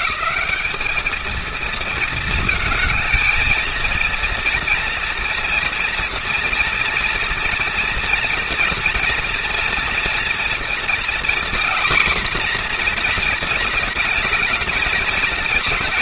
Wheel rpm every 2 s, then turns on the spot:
220, 220, 230, 230, 230, 240, 250, 220.
none